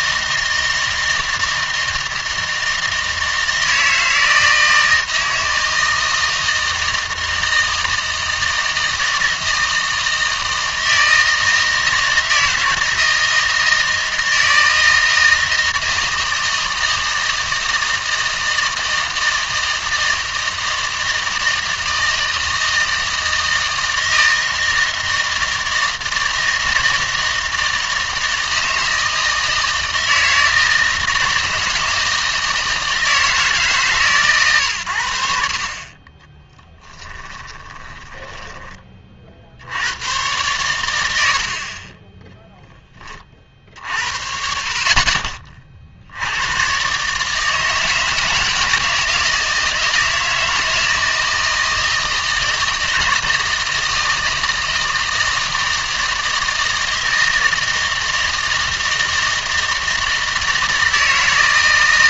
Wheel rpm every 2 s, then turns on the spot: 160, 160, 160, 160, 160, 160, 160, 160, 160, 160, 160, 160, 160, 160, 160, 160, 160, 120, 10, 20, 110, 10, 60, 120, 160, 160, 160, 160, 160, 160, 160.
36-38